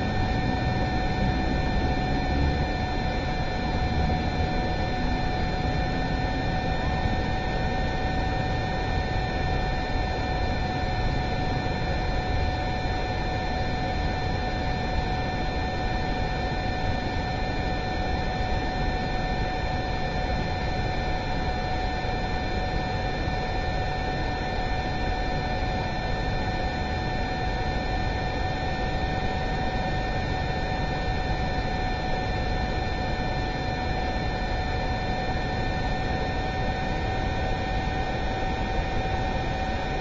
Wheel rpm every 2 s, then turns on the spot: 0, 0, 0, 0, 0, 0, 0, 0, 0, 0, 0, 0, 0, 0, 0, 0, 0, 0, 0, 0.
none